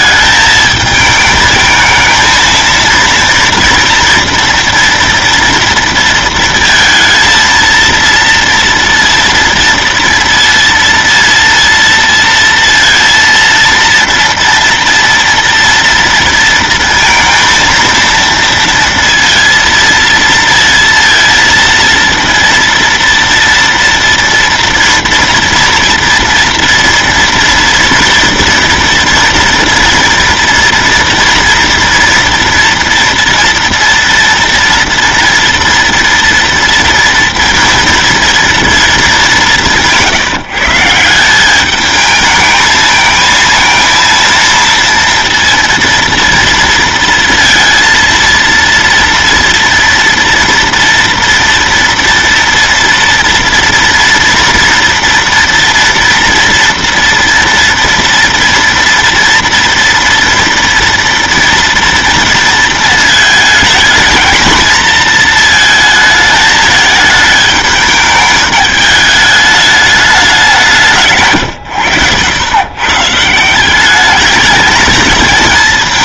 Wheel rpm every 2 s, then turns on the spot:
220, 230, 230, 230, 230, 230, 230, 230, 230, 230, 230, 230, 230, 230, 230, 230, 230, 240, 230, 230, 160, 220, 230, 230, 230, 230, 230, 230, 230, 230, 230, 230, 230, 220, 210, 190, 120, 220.
none